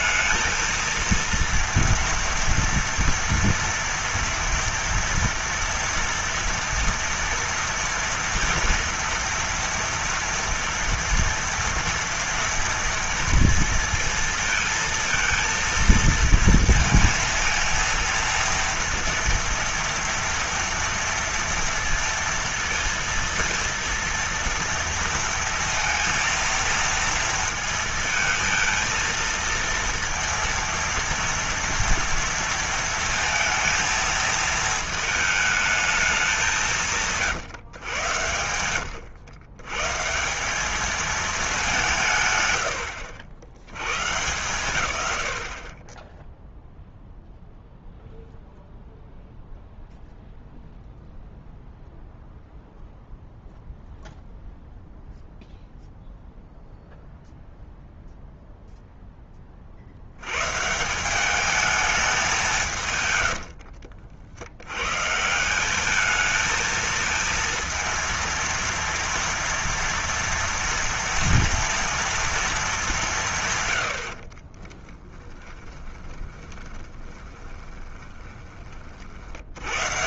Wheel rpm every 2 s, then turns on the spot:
220, 230, 230, 230, 230, 230, 230, 230, 230, 230, 230, 230, 230, 230, 230, 230, 230, 220, 180, 100, 200, 120, 120, 0, 0, 0, 0, 0, 0, 0, 130, 170, 100, 220, 230, 230, 220, 30, 20, 30.
42-44 74-78